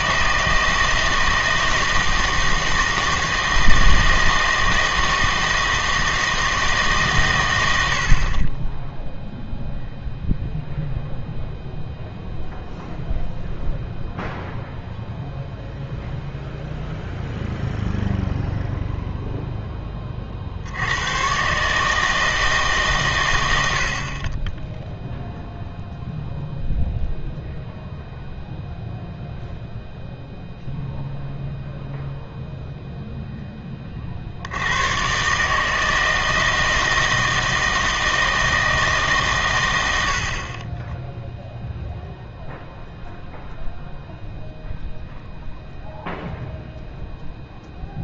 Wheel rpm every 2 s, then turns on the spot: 160, 160, 160, 150, 10, 0, 0, 0, 0, 0, 60, 150, 10, 0, 0, 0, 0, 90, 160, 160, 20, 0, 0, 0.
none